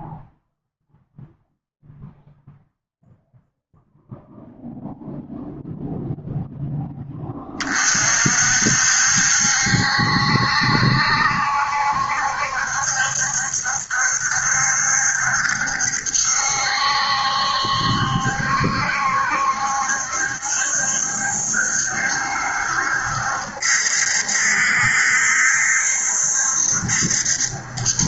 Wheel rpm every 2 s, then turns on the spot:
0, 0, 0, 10, 60, 70, 60, 70, 70, 70, 70, 70, 70, 70.
none